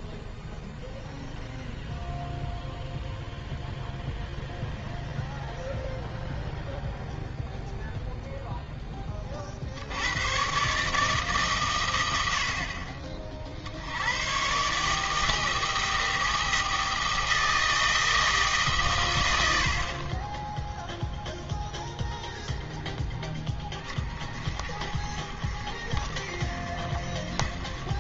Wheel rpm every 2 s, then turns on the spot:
0, 0, 0, 0, 70, 110, 100, 160, 160, 30, 0, 30, 50, 40.
none